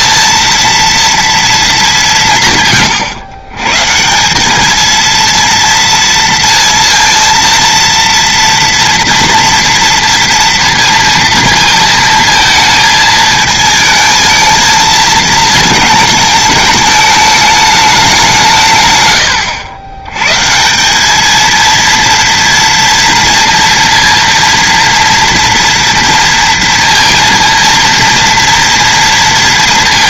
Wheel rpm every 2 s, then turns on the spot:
230, 130, 210, 230, 230, 230, 220, 220, 220, 140, 180, 230, 230, 230, 230.
none